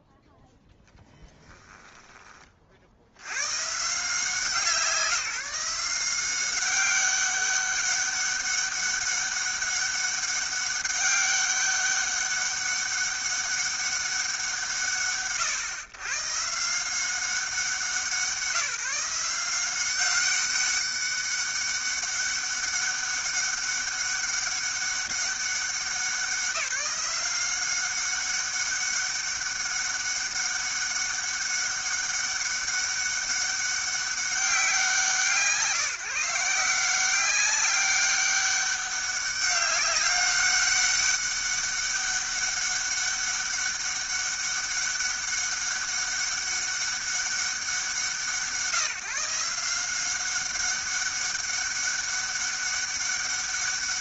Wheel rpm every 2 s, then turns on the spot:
0, 50, 170, 190, 200, 200, 200, 160, 150, 170, 200, 200, 200, 190, 200, 200, 200, 180, 180, 200, 200, 200, 200, 200, 160, 200, 200.
none